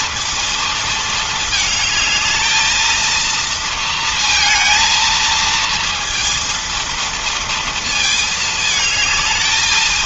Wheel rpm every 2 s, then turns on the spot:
230, 220, 230, 230, 220.
none